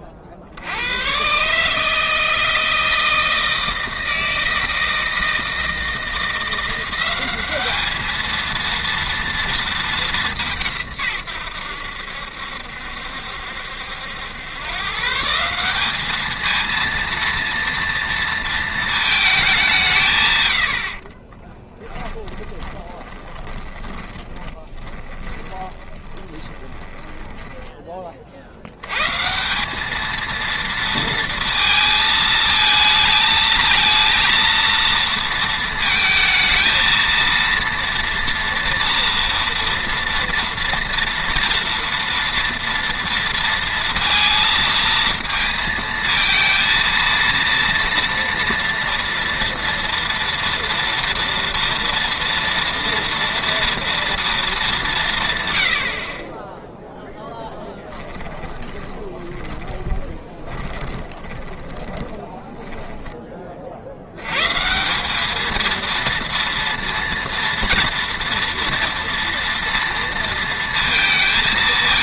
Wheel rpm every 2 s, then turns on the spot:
80, 160, 160, 180, 230, 150, 70, 120, 230, 230, 80, 20, 10, 20, 90, 230, 220, 230, 220, 230, 230, 230, 230, 230, 230, 230, 230, 200, 10, 30, 20, 20, 140, 230, 230, 230.
22-28 58-64